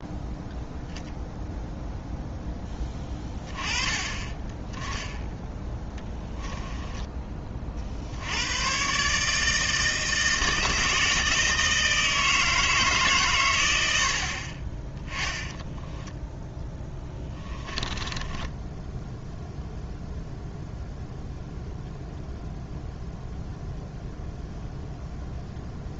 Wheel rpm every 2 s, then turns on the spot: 0, 10, 10, 10, 100, 160, 160, 30, 10, 10, 0, 0, 0.
6-8 16-20